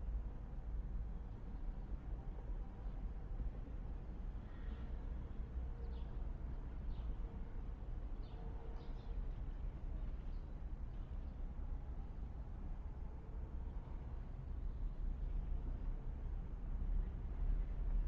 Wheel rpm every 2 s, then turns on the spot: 0, 0, 0, 0, 0, 0, 0, 0, 0.
none